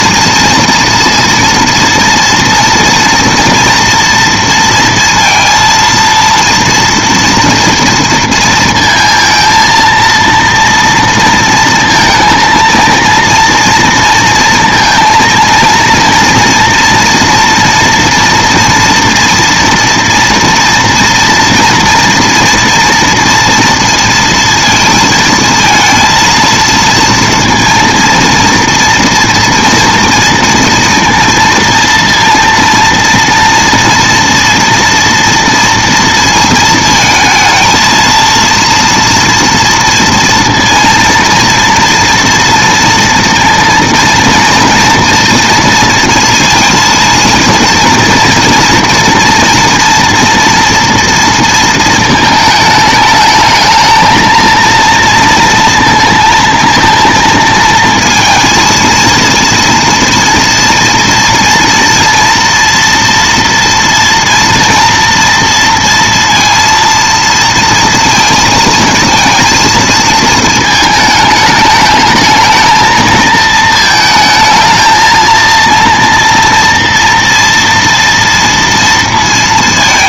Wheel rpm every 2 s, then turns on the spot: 230, 230, 230, 230, 230, 230, 230, 230, 230, 240, 230, 240, 230, 230, 230, 230, 230, 230, 230, 230, 230, 230, 230, 230, 240, 230, 220, 230, 230, 230, 230, 230, 230, 230, 230, 220, 220, 220, 230, 230.
none